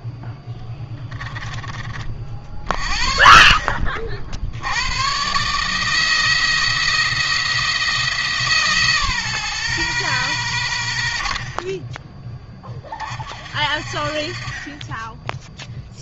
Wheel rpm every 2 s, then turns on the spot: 10, 50, 80, 170, 150, 100, 30, 30.
0-2